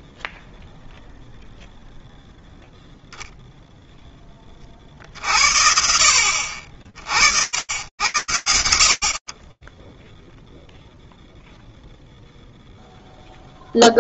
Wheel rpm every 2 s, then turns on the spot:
0, 0, 50, 50, 70, 0, 0.
none